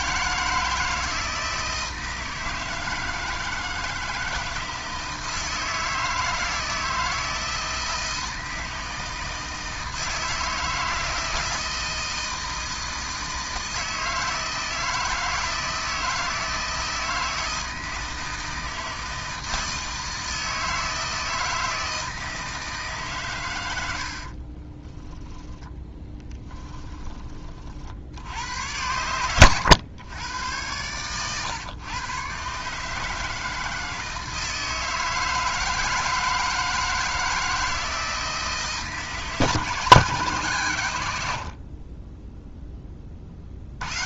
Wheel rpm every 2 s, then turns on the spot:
160, 160, 160, 160, 160, 160, 160, 160, 160, 160, 160, 160, 20, 10, 90, 100, 150, 160, 160, 160, 110, 10.
24-26